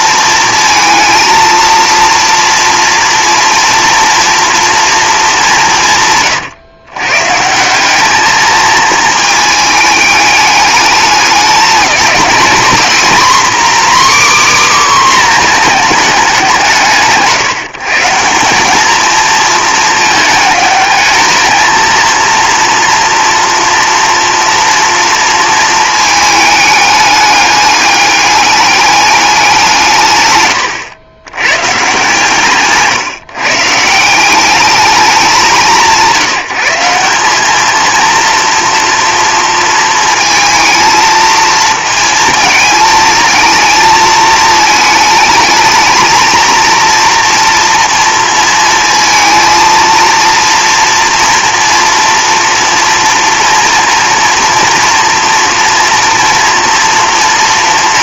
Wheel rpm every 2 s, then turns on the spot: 220, 230, 230, 120, 220, 210, 250, 270, 160, 210, 210, 230, 230, 210, 200, 100, 150, 210, 170, 230, 220, 220, 220, 230, 230, 230, 240, 230, 230.
none